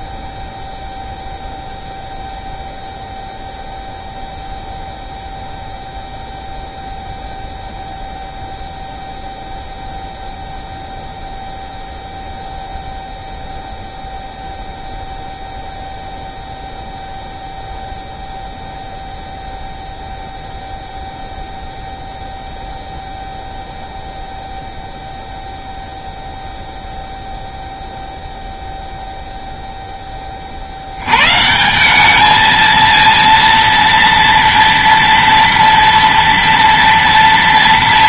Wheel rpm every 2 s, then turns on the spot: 0, 0, 0, 0, 0, 0, 0, 0, 0, 0, 0, 0, 0, 0, 0, 70, 230, 230, 230.
none